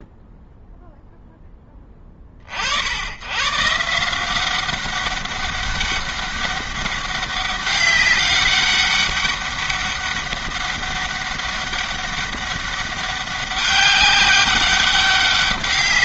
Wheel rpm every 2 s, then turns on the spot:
0, 60, 190, 200, 200, 200, 200, 200.
none